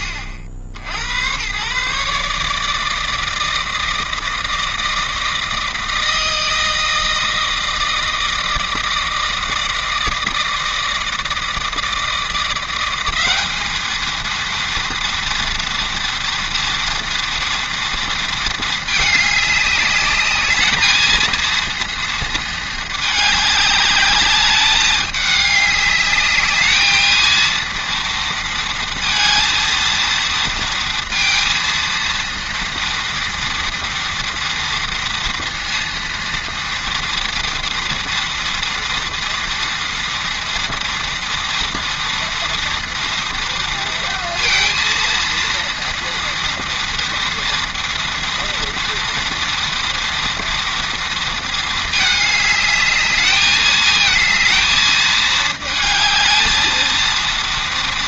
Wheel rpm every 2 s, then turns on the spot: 80, 160, 160, 160, 160, 160, 190, 230, 230, 220, 220, 220, 210, 220, 230, 230, 230, 230, 230, 230, 230, 230, 230, 230, 230, 230, 210, 220, 230.
none